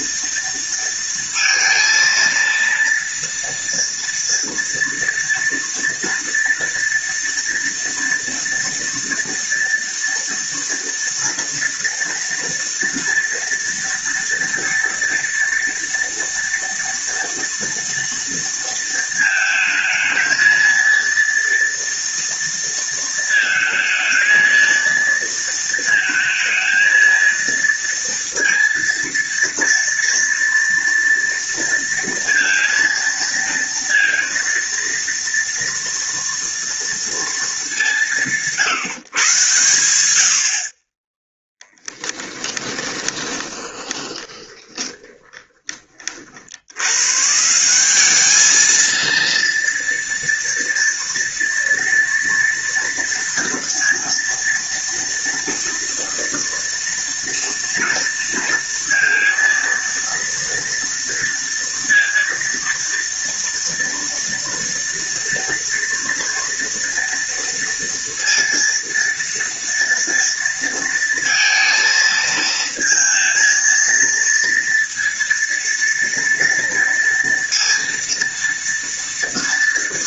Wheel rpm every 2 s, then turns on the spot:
230, 230, 230, 230, 230, 230, 230, 230, 230, 230, 230, 230, 230, 230, 230, 230, 230, 230, 230, 160, 30, 10, 20, 110, 220, 230, 230, 230, 230, 230, 230, 230, 230, 230, 230, 230, 230, 230, 230, 230.
42-46